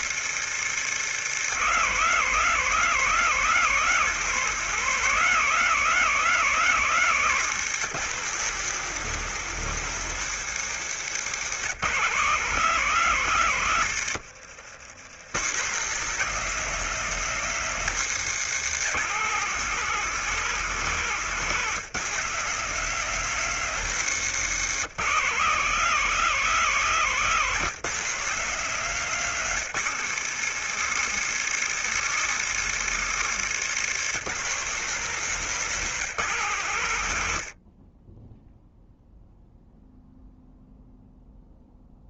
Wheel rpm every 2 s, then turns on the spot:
150, 180, 180, 170, 170, 160, 150, 110, 170, 150, 160, 180, 170, 160, 170, 170, 160, 170, 80, 0, 0.
6-8 28-30